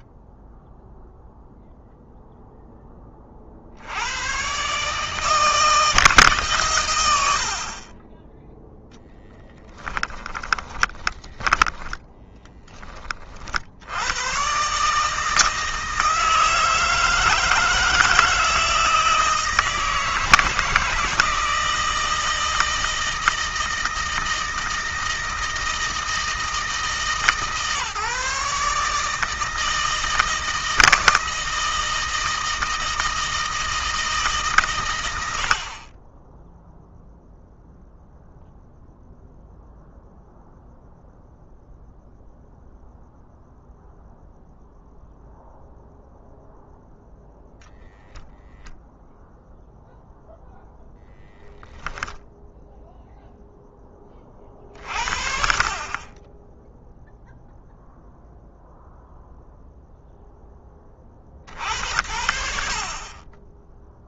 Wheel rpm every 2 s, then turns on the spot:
0, 20, 150, 130, 0, 10, 20, 140, 160, 160, 160, 160, 160, 160, 150, 160, 160, 110, 0, 0, 0, 0, 0, 0, 0, 0, 0, 50, 10, 0, 30, 30.
10-12